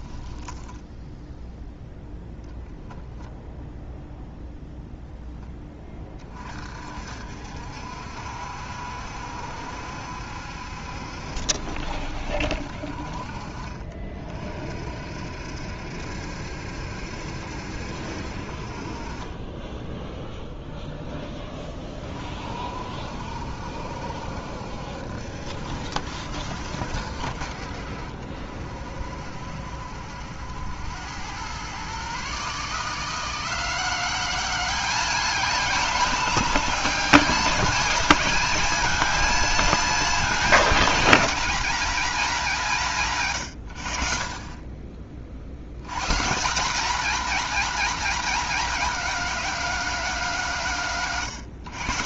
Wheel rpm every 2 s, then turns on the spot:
10, 0, 0, 50, 70, 70, 50, 50, 70, 40, 0, 50, 70, 70, 60, 90, 160, 210, 220, 220, 220, 160, 30, 230, 220, 150.
0-2